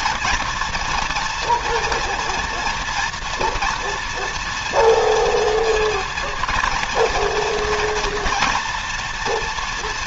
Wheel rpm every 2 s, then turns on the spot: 230, 230, 230, 230, 210.
none